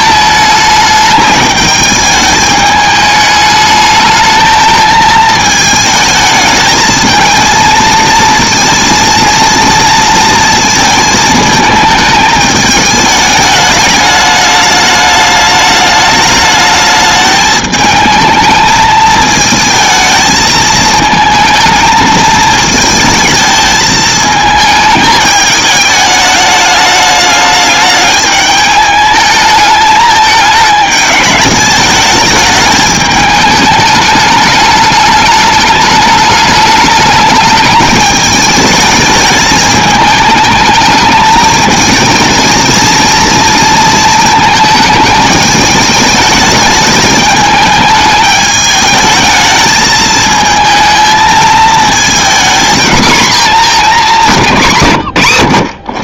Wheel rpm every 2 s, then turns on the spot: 210, 210, 220, 220, 230, 220, 210, 210, 210, 220, 220, 220, 220, 210, 210, 220, 210, 210, 210, 210, 210, 220, 220, 210, 210, 220, 240, 170.
54-56